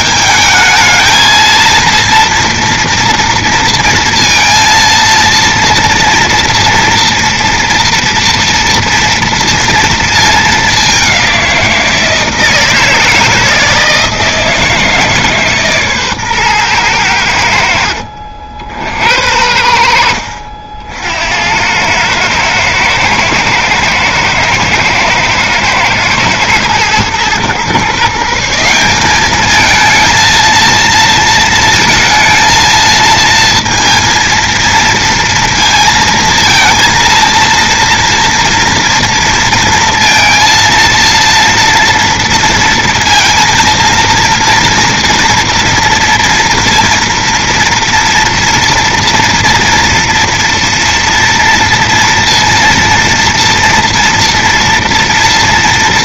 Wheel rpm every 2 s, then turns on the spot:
220, 230, 230, 240, 230, 220, 170, 160, 140, 60, 70, 110, 120, 110, 140, 220, 230, 230, 220, 230, 230, 240, 230, 230, 230, 230, 230, 240.
18-20